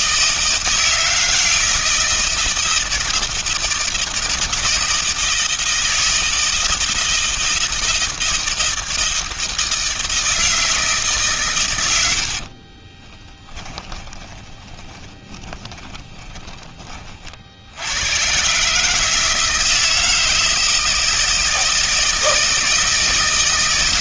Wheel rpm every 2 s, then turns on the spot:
160, 160, 160, 160, 160, 160, 50, 20, 20, 140, 160, 160.
12-16